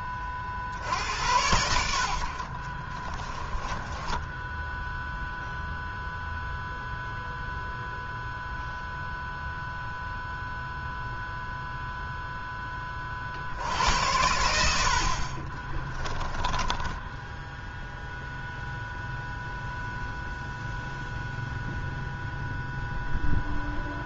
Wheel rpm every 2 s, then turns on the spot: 50, 40, 0, 0, 0, 0, 20, 80, 20, 0, 0, 0.
2-4 16-18